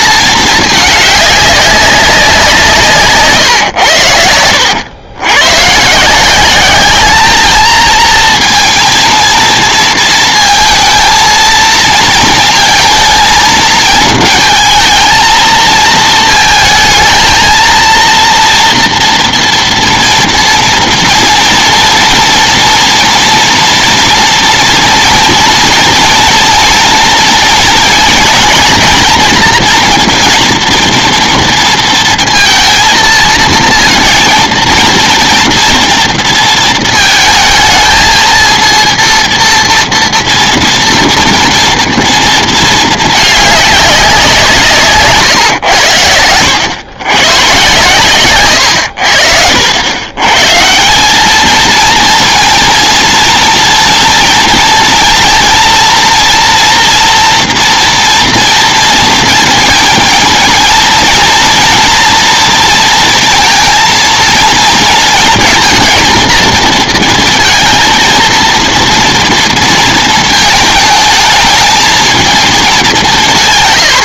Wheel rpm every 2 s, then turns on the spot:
210, 170, 100, 200, 230, 220, 220, 220, 220, 230, 230, 230, 230, 230, 230, 240, 230, 230, 230, 230, 230, 220, 150, 100, 100, 160, 230, 230, 230, 230, 230, 230, 230, 230, 230, 220, 200.
none